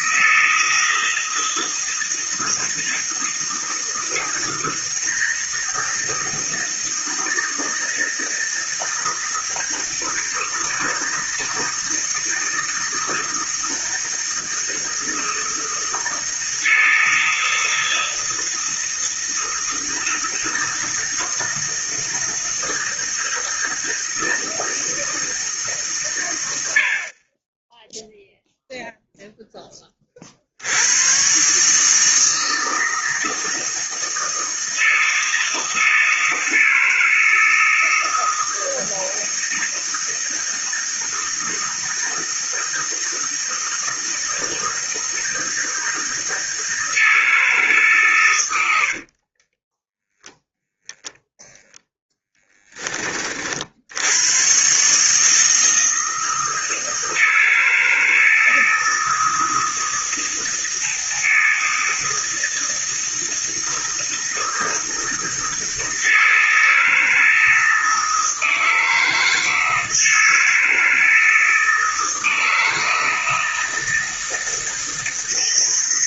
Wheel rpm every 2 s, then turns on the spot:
160, 160, 160, 160, 160, 160, 160, 160, 160, 160, 160, 160, 160, 90, 0, 80, 160, 160, 160, 160, 160, 160, 160, 160, 80, 0, 20, 130, 160, 160, 160, 160, 160, 160, 160, 160, 160, 160.
48-50